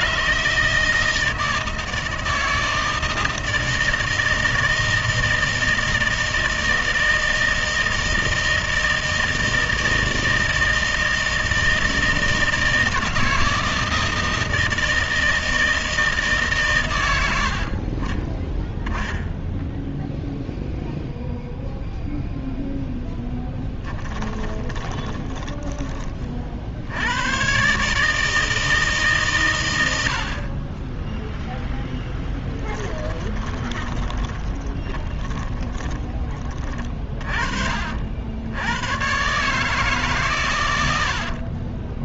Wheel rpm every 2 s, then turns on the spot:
160, 160, 160, 160, 160, 160, 160, 160, 130, 10, 0, 0, 10, 60, 160, 40, 10, 20, 20, 90, 130.
24-26 32-36